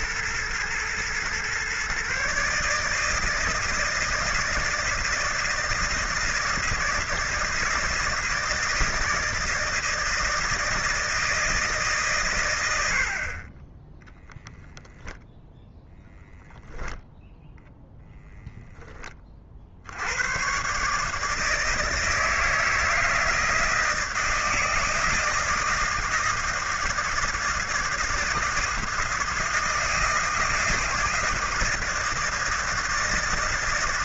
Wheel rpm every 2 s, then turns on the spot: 120, 140, 160, 160, 160, 160, 110, 10, 0, 0, 110, 160, 160, 160, 160, 160, 160.
none